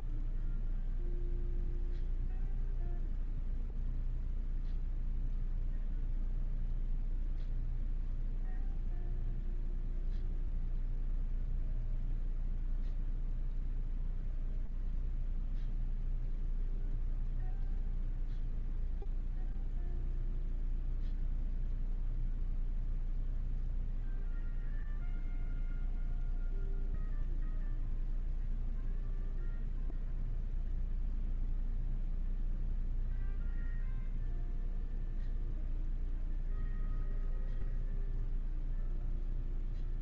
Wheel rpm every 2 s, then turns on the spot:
0, 0, 0, 0, 0, 0, 0, 0, 0, 0, 0, 0, 0, 0, 0, 0, 0, 0, 0, 0.
none